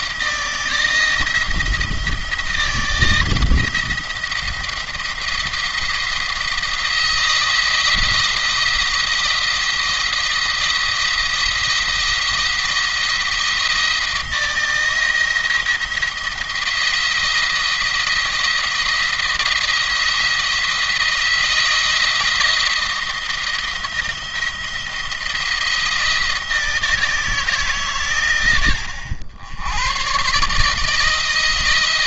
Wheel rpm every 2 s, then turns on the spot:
160, 170, 170, 170, 170, 170, 170, 160, 170, 160, 170, 160, 170, 160, 100, 140.
none